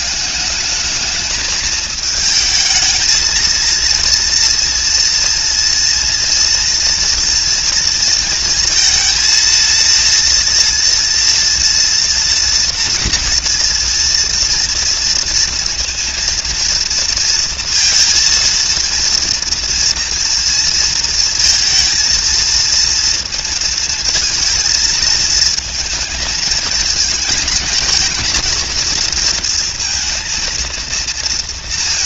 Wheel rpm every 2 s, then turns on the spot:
210, 220, 240, 230, 230, 240, 240, 230, 230, 230, 230, 220, 230, 220, 230, 230.
none